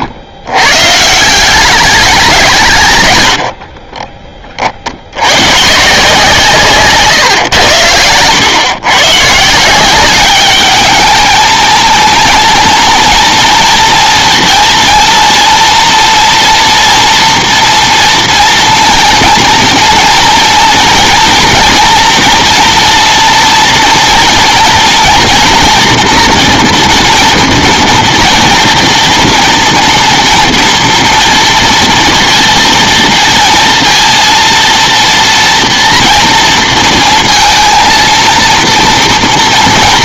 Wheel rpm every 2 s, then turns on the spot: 120, 160, 50, 140, 120, 210, 230, 230, 230, 230, 230, 230, 230, 230, 230, 230, 230, 230, 230, 230.
none